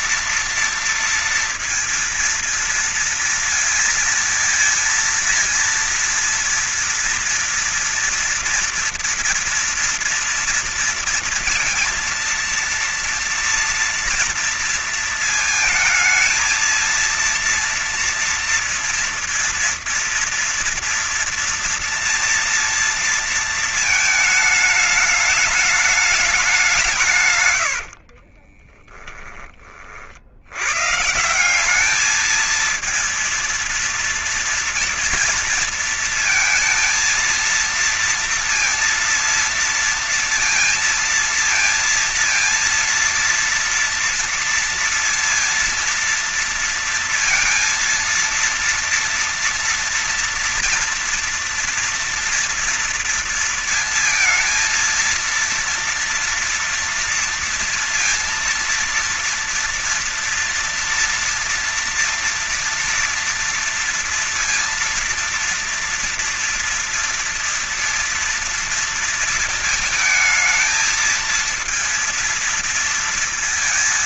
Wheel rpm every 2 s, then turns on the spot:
230, 230, 230, 230, 230, 230, 230, 230, 230, 230, 230, 230, 220, 190, 40, 120, 220, 230, 230, 230, 230, 230, 230, 230, 230, 230, 230, 230, 230, 230, 230, 230, 230, 230, 230, 220, 230.
28-30